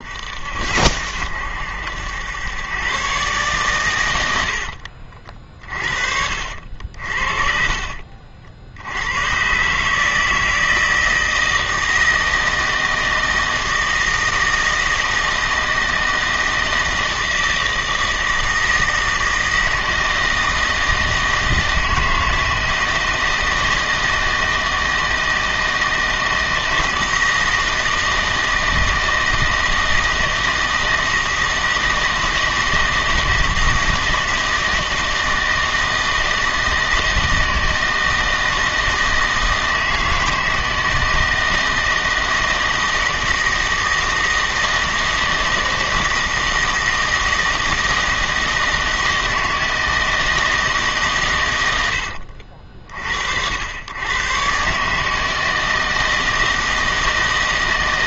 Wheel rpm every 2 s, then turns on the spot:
70, 120, 60, 60, 80, 160, 160, 160, 160, 160, 160, 160, 160, 160, 160, 160, 160, 160, 160, 160, 160, 160, 160, 160, 160, 150, 50, 140, 160.
4-6